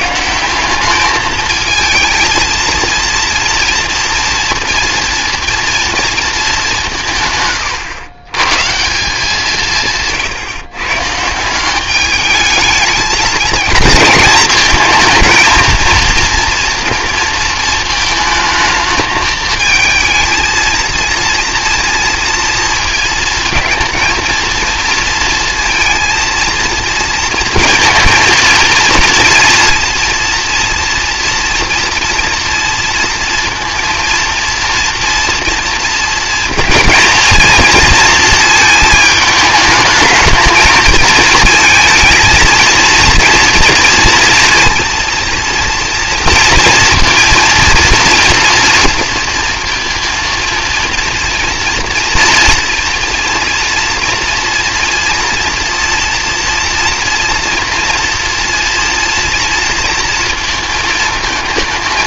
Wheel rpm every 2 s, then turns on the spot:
190, 230, 240, 200, 150, 130, 220, 220, 230, 220, 220, 230, 230, 230, 230, 230, 230, 230, 230, 220, 220, 230, 230, 230, 230, 230, 230, 230, 230, 230, 230.
none